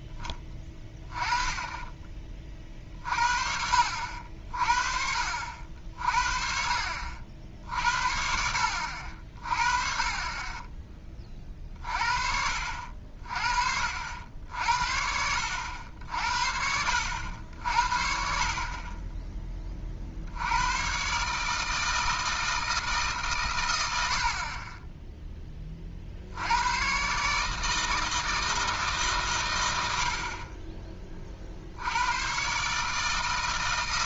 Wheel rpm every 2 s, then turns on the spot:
20, 40, 50, 50, 60, 20, 50, 70, 70, 40, 100, 160, 20, 110, 160, 30, 140.
none